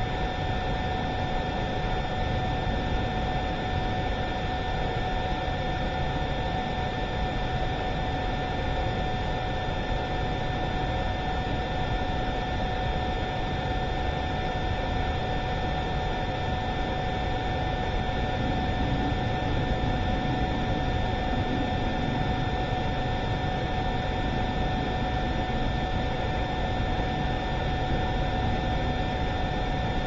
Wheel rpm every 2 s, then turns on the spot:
0, 0, 0, 0, 0, 0, 0, 0, 0, 0, 0, 0, 0, 0, 0.
none